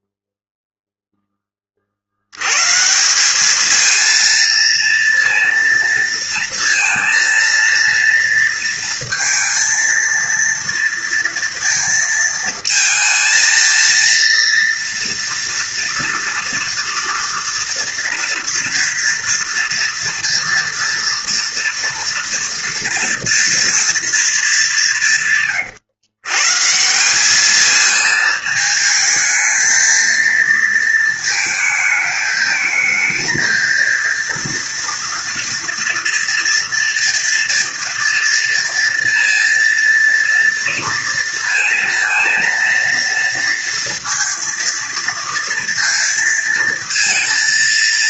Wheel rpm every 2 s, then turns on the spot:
0, 130, 230, 230, 230, 230, 230, 230, 230, 230, 230, 230, 200, 140, 220, 230, 220, 230, 230, 230, 230, 230, 230, 230.
none